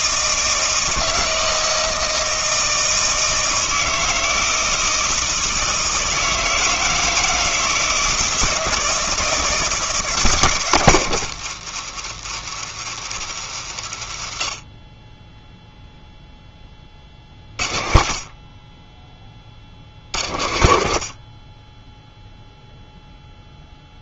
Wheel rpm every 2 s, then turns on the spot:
160, 160, 160, 160, 160, 140, 110, 40, 10, 30, 60, 0.
none